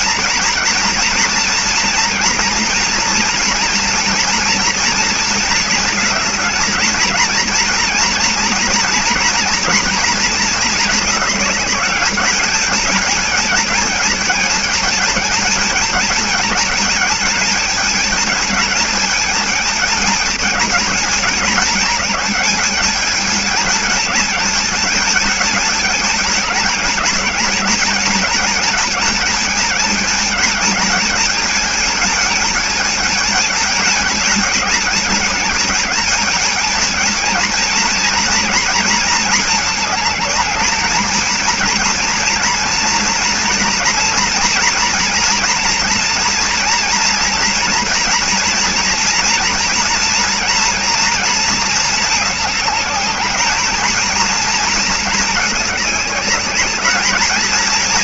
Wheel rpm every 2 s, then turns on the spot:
230, 230, 240, 220, 240, 220, 210, 220, 220, 220, 220, 210, 220, 220, 220, 220, 220, 210, 220, 230, 220, 230, 240, 230, 230, 230, 210, 230, 210.
none